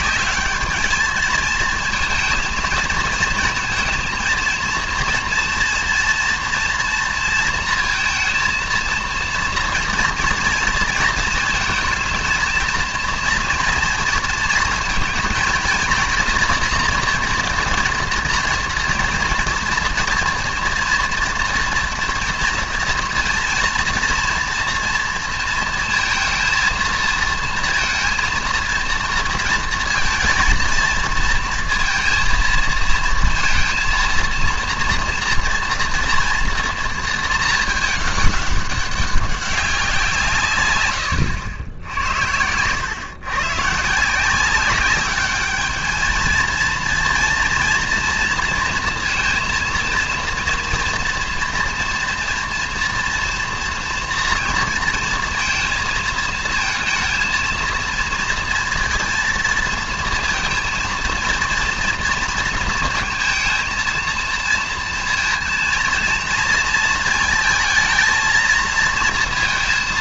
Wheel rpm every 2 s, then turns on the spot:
210, 230, 230, 240, 230, 230, 230, 230, 240, 230, 230, 230, 230, 230, 230, 230, 230, 230, 230, 200, 120, 100, 190, 220, 230, 230, 230, 230, 220, 230, 230, 230, 230, 230, 230.
none